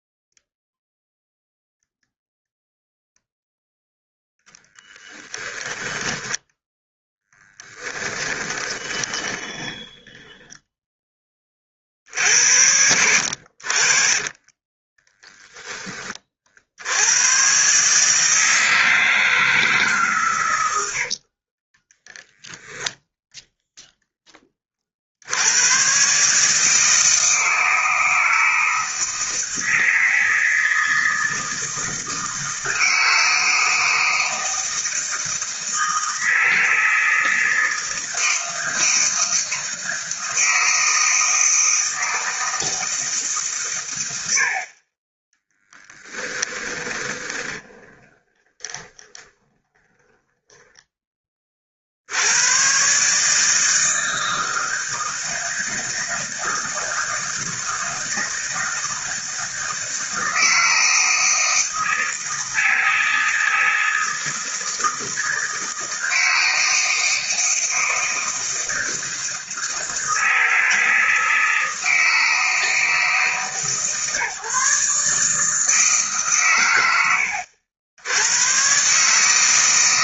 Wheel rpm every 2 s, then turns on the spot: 0, 0, 10, 10, 20, 10, 80, 10, 80, 160, 70, 0, 40, 160, 160, 160, 160, 160, 160, 160, 160, 160, 40, 20, 20, 10, 120, 160, 160, 160, 160, 160, 160, 160, 160, 160, 160, 150, 100, 120.
4-10 12-16 20-22 46-50